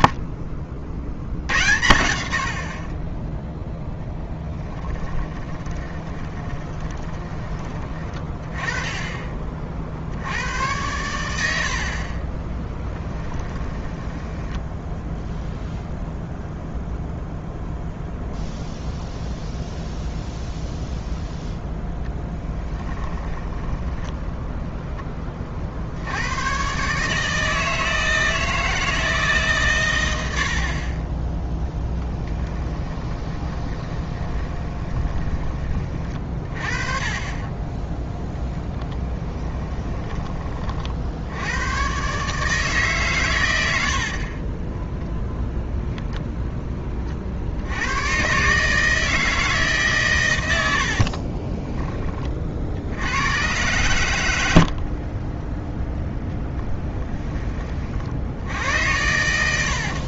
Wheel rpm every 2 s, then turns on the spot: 50, 50, 10, 20, 20, 100, 10, 10, 0, 0, 0, 20, 0, 130, 160, 50, 10, 20, 40, 10, 40, 150, 10, 10, 150, 80, 60, 60, 10, 90.
6-8 12-16 22-24 32-36 44-46